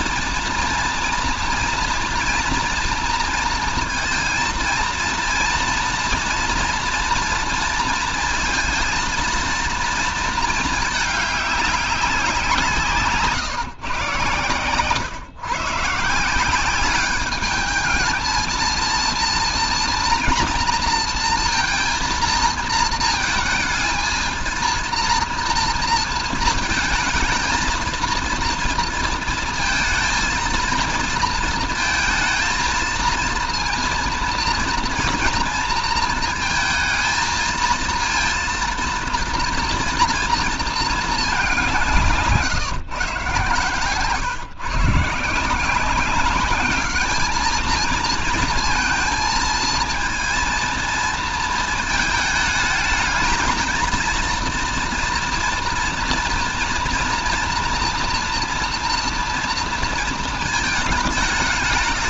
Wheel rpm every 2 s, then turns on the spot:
230, 230, 230, 230, 230, 220, 170, 120, 190, 230, 230, 230, 230, 230, 230, 230, 230, 230, 220, 230, 230, 140, 140, 210, 220, 230, 210, 230, 230, 230, 220.
12-14